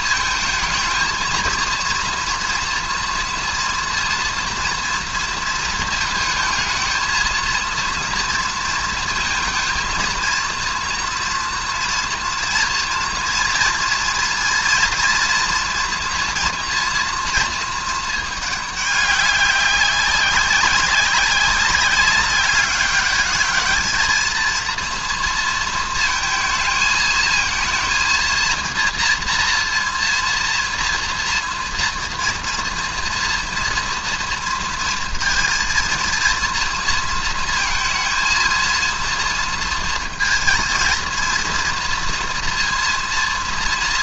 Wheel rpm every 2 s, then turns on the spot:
230, 230, 240, 220, 230, 230, 240, 230, 230, 210, 190, 200, 230, 230, 230, 230, 230, 230, 230, 230, 230, 230.
none